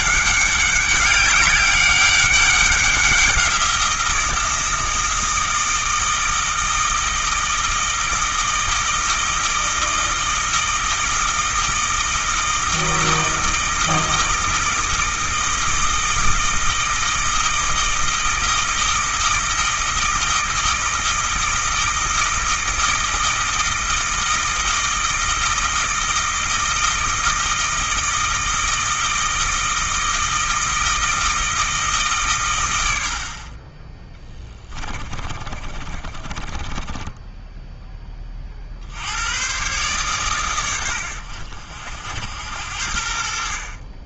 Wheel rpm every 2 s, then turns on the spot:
190, 190, 160, 160, 160, 160, 160, 160, 160, 160, 160, 160, 160, 160, 160, 160, 90, 20, 20, 60, 110, 70.
34-38